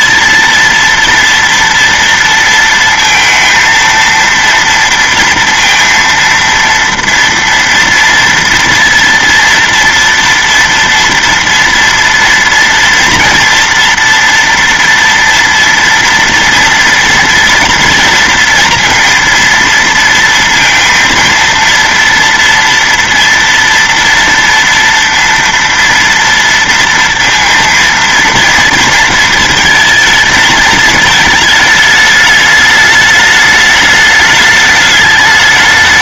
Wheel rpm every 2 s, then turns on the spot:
230, 230, 230, 230, 230, 230, 230, 240, 240, 230, 230, 230, 230, 230, 230, 220, 210, 210.
none